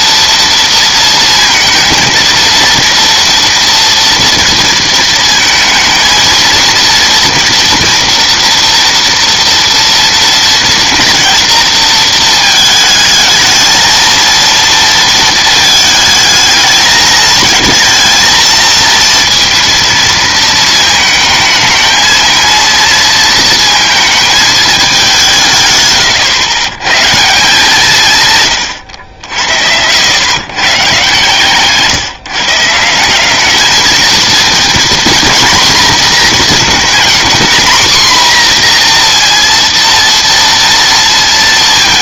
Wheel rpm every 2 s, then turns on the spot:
230, 230, 230, 230, 230, 230, 220, 230, 220, 230, 220, 230, 210, 110, 120, 140, 160, 230, 240, 240, 230.
none